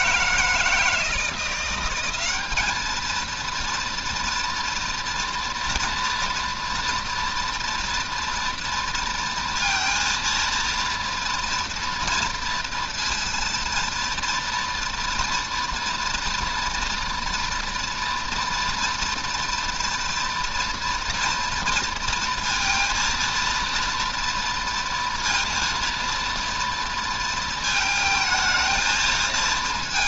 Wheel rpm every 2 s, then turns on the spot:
160, 220, 230, 240, 230, 230, 230, 230, 240, 240, 240, 230, 230, 230, 220.
none